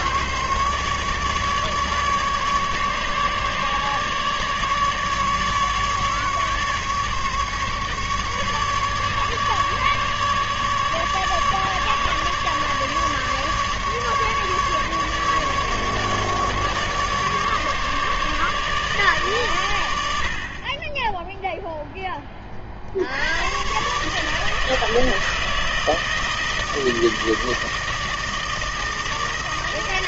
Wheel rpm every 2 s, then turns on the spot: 150, 150, 150, 150, 150, 150, 150, 150, 150, 150, 40, 30, 160, 160, 160.
none